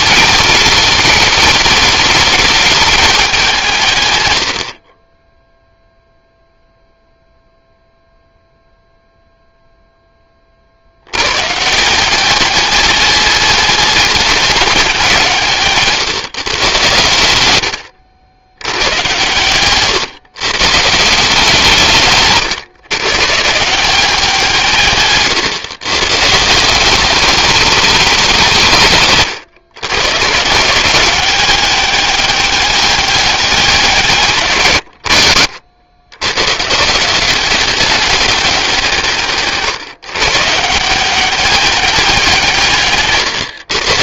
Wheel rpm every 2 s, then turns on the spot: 210, 170, 0, 0, 0, 140, 210, 150, 90, 130, 170, 160, 130, 210, 120, 190, 170, 70, 190, 150, 190, 130.
none